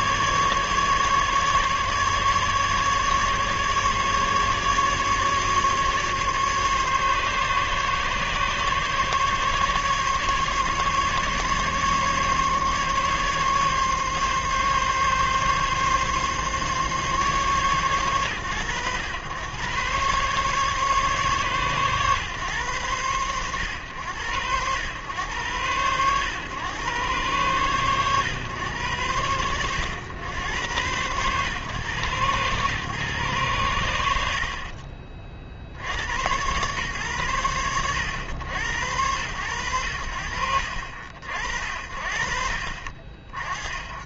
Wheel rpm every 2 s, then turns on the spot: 140, 150, 140, 140, 140, 140, 140, 140, 140, 110, 140, 110, 110, 120, 110, 100, 110, 20, 110, 90, 50, 50.
none